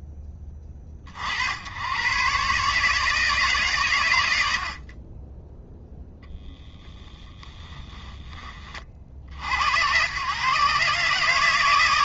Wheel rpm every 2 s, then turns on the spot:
50, 150, 10, 10, 60, 150.
6-8